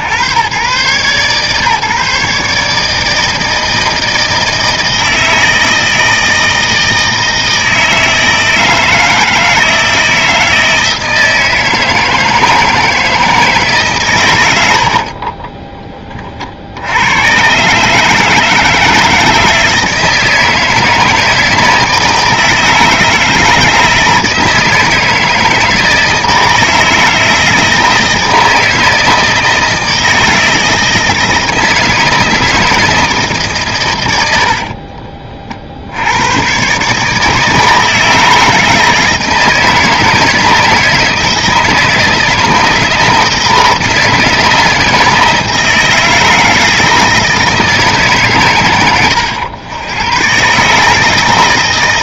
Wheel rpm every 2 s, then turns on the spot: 120, 150, 160, 160, 160, 160, 160, 80, 70, 160, 160, 160, 160, 160, 160, 160, 160, 60, 140, 160, 160, 160, 160, 160, 110, 140.
34-36